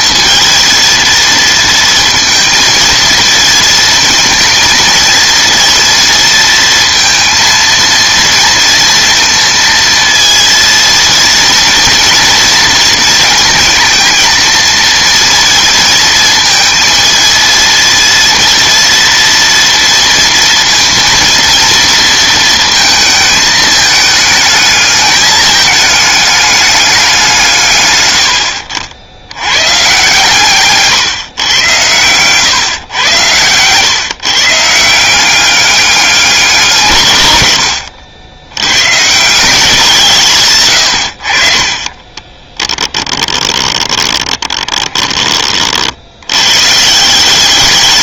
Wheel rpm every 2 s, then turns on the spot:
220, 230, 230, 230, 230, 230, 230, 230, 220, 230, 230, 230, 210, 210, 80, 140, 120, 140, 190, 90, 130, 10, 20, 120.
28-30 40-46